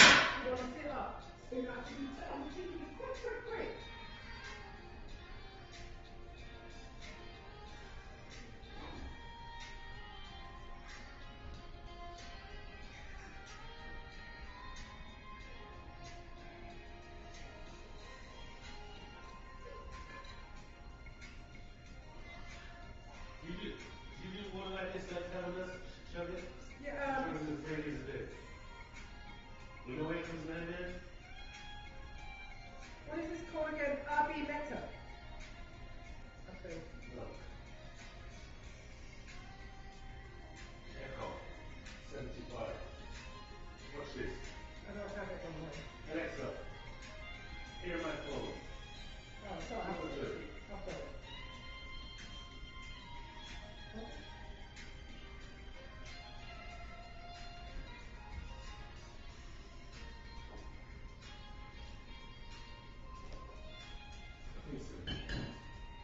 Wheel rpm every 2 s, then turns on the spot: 0, 0, 0, 0, 0, 0, 0, 0, 0, 0, 0, 0, 0, 0, 0, 0, 0, 0, 0, 0, 0, 0, 0, 0, 0, 0, 0, 0, 0, 0, 0, 0, 0.
none